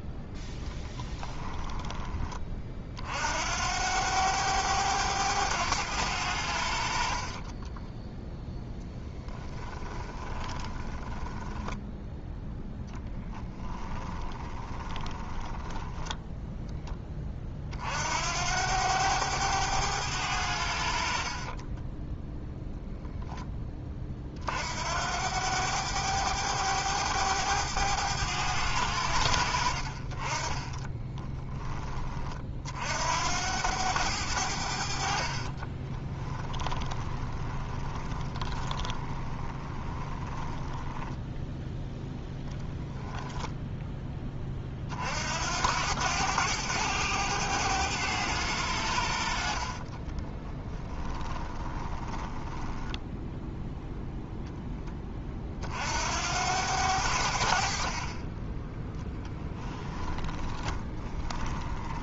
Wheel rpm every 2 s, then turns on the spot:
10, 50, 100, 70, 10, 20, 10, 20, 10, 90, 60, 10, 80, 100, 80, 20, 60, 50, 20, 20, 10, 0, 50, 100, 80, 20, 10, 20, 80, 10, 20.
0-2 8-12 14-16 30-32 34-42 50-52 60-62